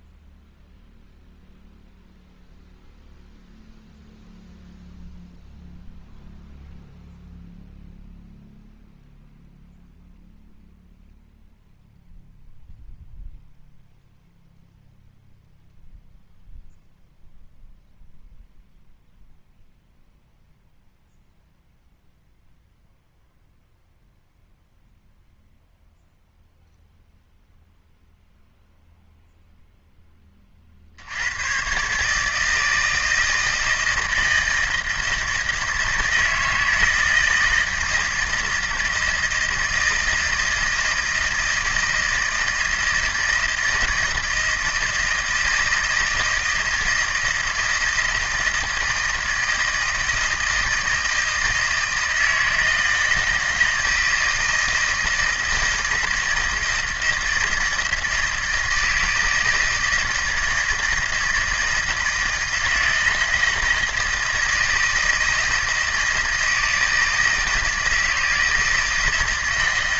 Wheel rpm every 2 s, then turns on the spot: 0, 0, 0, 0, 0, 0, 0, 0, 0, 0, 0, 0, 0, 0, 0, 50, 160, 160, 160, 160, 160, 160, 160, 160, 160, 160, 160, 160, 160, 160, 160, 160, 160, 160, 160.
none